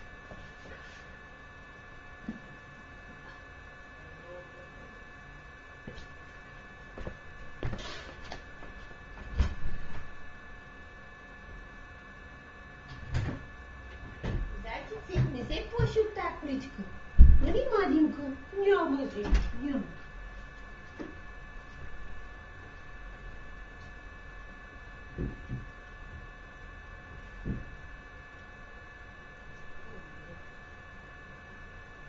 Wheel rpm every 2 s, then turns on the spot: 0, 0, 0, 0, 0, 0, 0, 0, 0, 0, 0, 0, 0, 0, 0, 0.
none